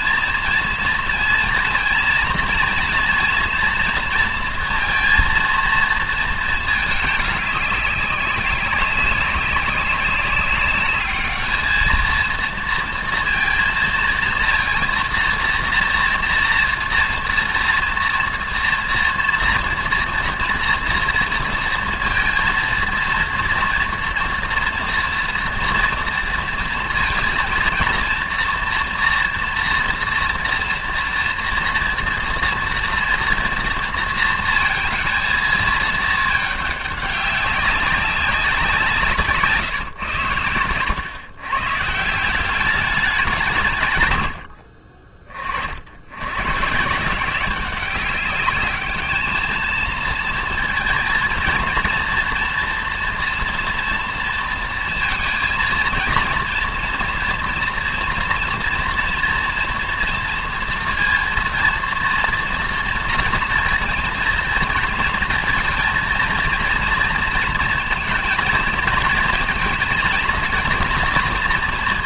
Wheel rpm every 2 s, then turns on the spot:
230, 230, 230, 220, 190, 200, 220, 230, 230, 230, 230, 230, 230, 230, 230, 230, 230, 230, 210, 190, 120, 190, 80, 120, 200, 230, 240, 230, 230, 230, 230, 230, 230, 230, 230, 230.
none